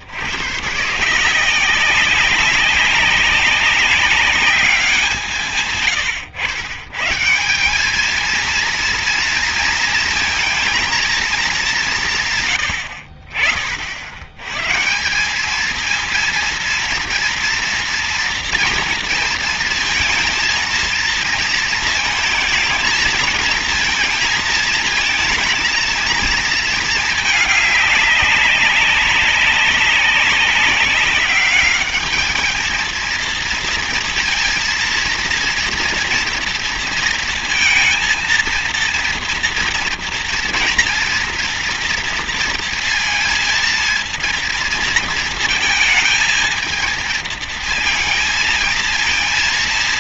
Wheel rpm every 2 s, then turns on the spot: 130, 200, 190, 120, 230, 230, 90, 140, 230, 230, 230, 220, 230, 220, 190, 200, 220, 230, 230, 230, 230, 230, 230, 230, 230.
none